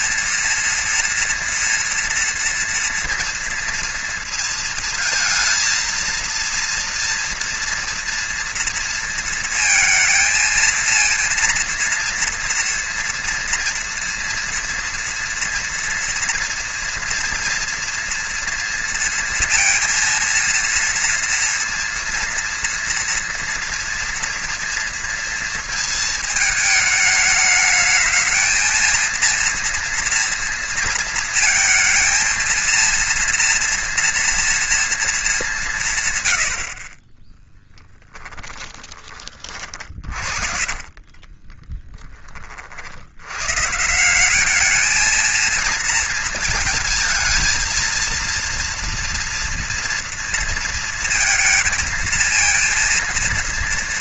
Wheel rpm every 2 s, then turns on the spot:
230, 230, 230, 230, 230, 220, 230, 230, 230, 230, 230, 230, 230, 220, 220, 230, 230, 230, 110, 10, 40, 30, 190, 220, 230, 230, 230.
38-42